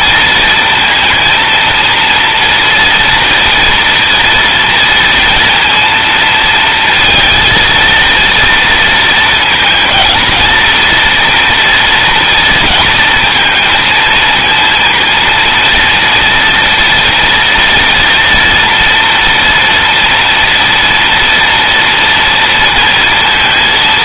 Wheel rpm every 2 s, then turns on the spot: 230, 230, 230, 230, 230, 230, 230, 230, 240, 240, 230, 230.
none